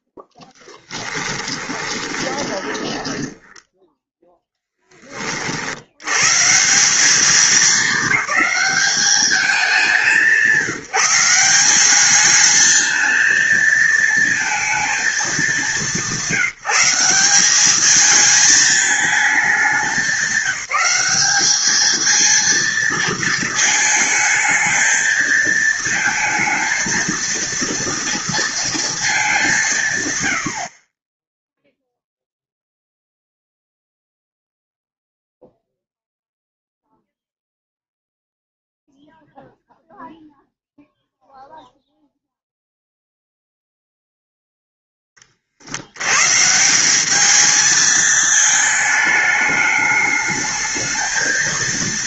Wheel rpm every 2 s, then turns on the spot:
10, 10, 10, 170, 210, 160, 220, 220, 170, 220, 190, 230, 220, 220, 230, 60, 0, 0, 0, 0, 0, 0, 0, 170, 220, 220.
0-4